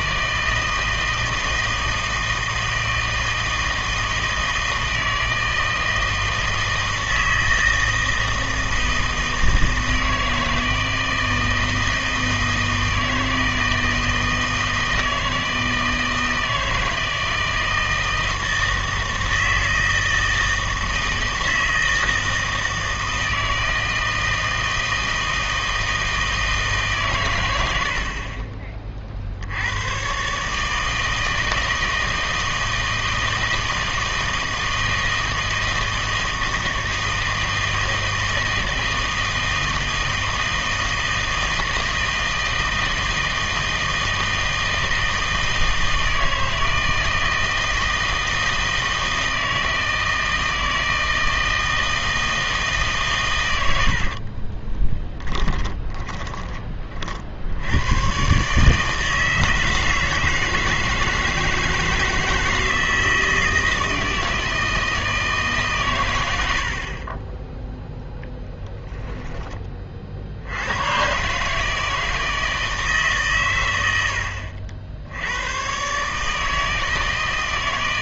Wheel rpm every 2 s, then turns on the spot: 160, 160, 160, 160, 160, 160, 160, 160, 160, 160, 160, 160, 160, 150, 30, 150, 160, 160, 160, 160, 160, 160, 160, 160, 160, 160, 150, 20, 20, 150, 160, 160, 160, 70, 10, 90, 160, 70, 160.
54-56 68-70